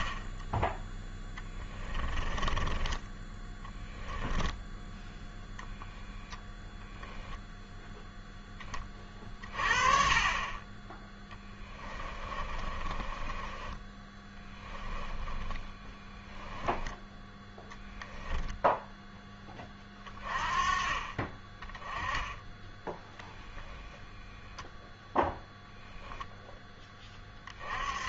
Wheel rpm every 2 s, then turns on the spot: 10, 20, 10, 0, 20, 20, 30, 20, 10, 10, 30, 10, 0, 10.
0-4 12-16